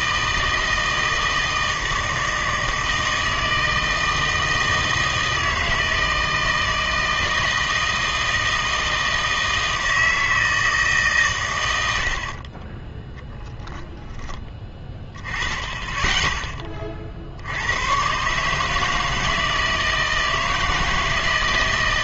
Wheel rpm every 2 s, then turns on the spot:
160, 160, 160, 160, 160, 160, 30, 10, 20, 150, 160.
none